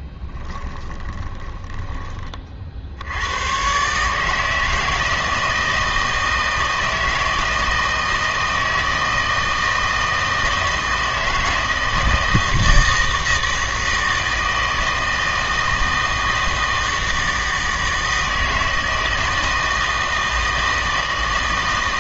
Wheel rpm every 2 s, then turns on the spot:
10, 50, 160, 160, 160, 160, 160, 160, 160, 160, 160.
none